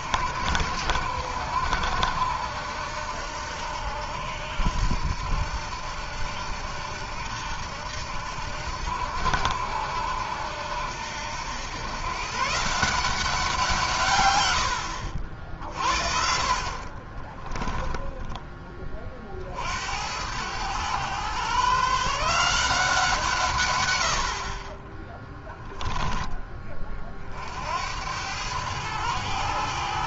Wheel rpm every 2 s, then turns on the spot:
80, 80, 80, 80, 80, 80, 170, 70, 50, 30, 110, 170, 40, 30, 100.
16-18